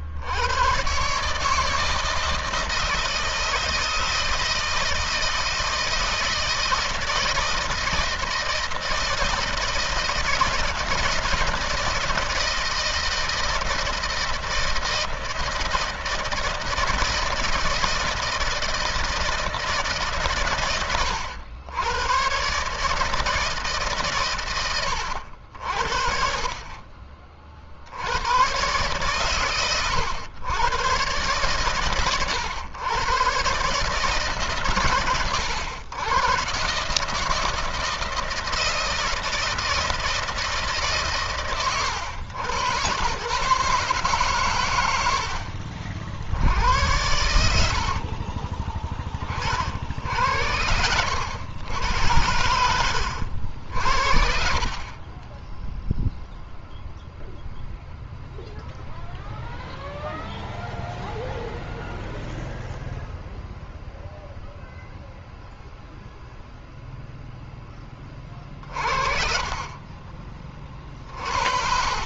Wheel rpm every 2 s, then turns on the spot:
120, 160, 160, 160, 160, 160, 160, 160, 160, 160, 110, 150, 100, 30, 130, 120, 110, 120, 140, 160, 150, 110, 100, 80, 20, 90, 90, 40, 0, 0, 0, 0, 0, 0, 40, 30.
46-48 70-72